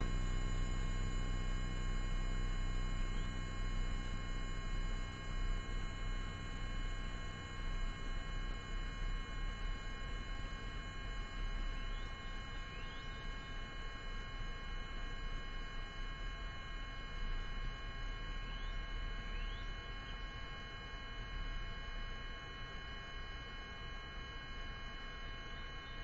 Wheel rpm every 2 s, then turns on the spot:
0, 0, 0, 0, 0, 0, 0, 0, 0, 0, 0, 0, 0.
none